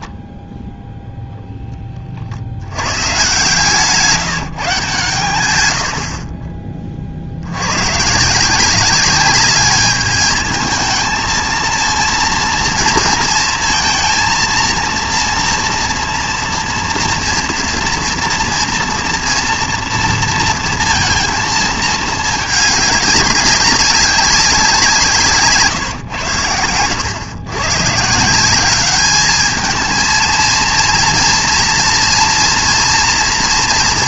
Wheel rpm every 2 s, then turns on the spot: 0, 80, 160, 30, 170, 220, 230, 230, 230, 240, 230, 210, 190, 100, 190, 220, 240.
26-28